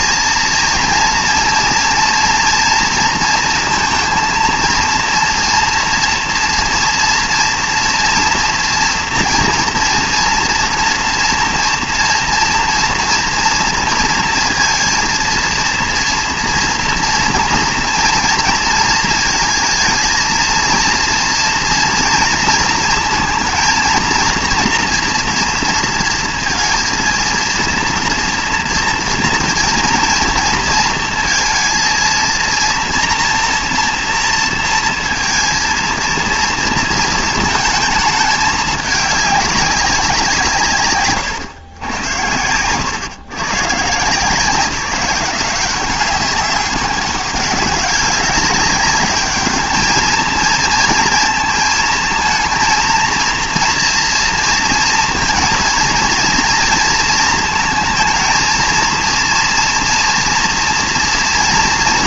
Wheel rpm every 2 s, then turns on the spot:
230, 230, 240, 230, 230, 230, 230, 230, 230, 230, 230, 230, 230, 230, 230, 230, 230, 230, 230, 210, 130, 110, 180, 200, 200, 230, 230, 230, 230, 230, 230.
40-42